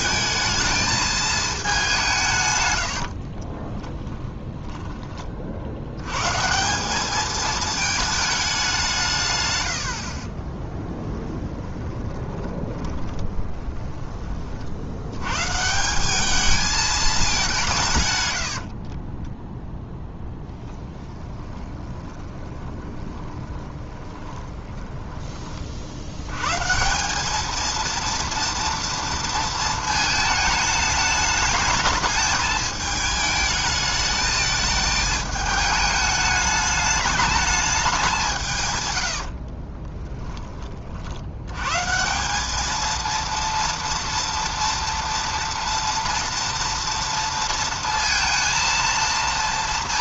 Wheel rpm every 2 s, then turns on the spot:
220, 100, 10, 180, 190, 20, 20, 60, 220, 60, 10, 30, 10, 150, 230, 210, 220, 210, 210, 130, 40, 220, 230, 230, 230.
10-14 18-26